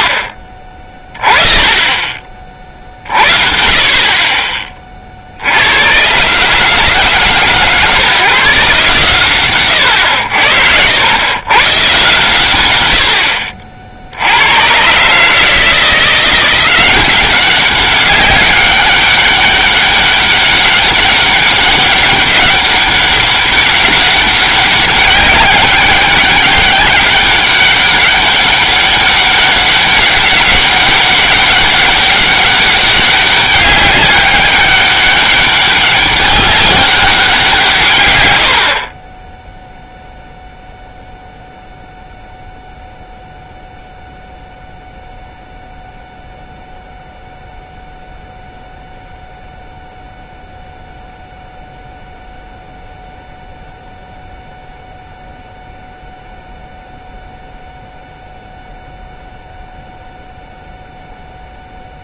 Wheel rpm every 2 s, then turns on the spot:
30, 50, 40, 140, 140, 80, 80, 140, 190, 200, 200, 200, 200, 200, 200, 200, 200, 200, 190, 10, 0, 0, 0, 0, 0, 0, 0, 0, 0, 0, 0.
none